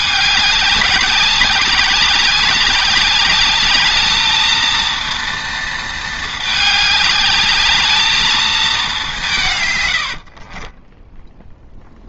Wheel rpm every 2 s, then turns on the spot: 200, 200, 230, 210, 200, 20.
none